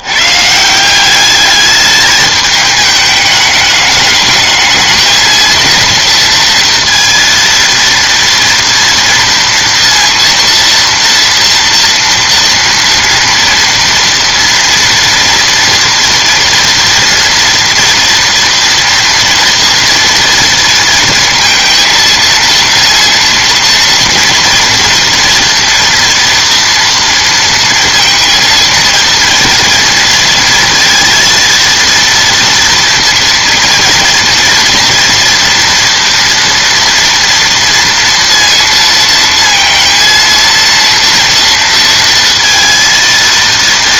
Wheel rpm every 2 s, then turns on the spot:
150, 210, 210, 230, 230, 230, 230, 240, 230, 230, 230, 230, 230, 230, 230, 230, 230, 230, 230, 230, 230, 230.
none